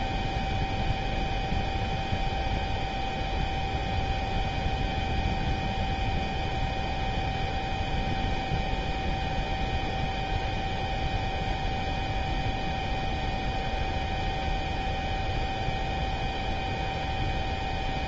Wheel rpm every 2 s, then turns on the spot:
0, 0, 0, 0, 0, 0, 0, 0, 0.
none